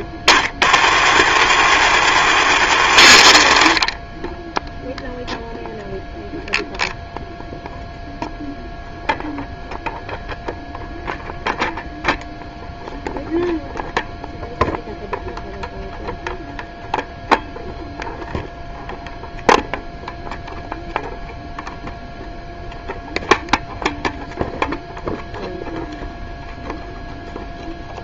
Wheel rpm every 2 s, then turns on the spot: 30, 60, 0, 0, 0, 0, 0, 0, 0, 0, 0, 0, 0, 0.
none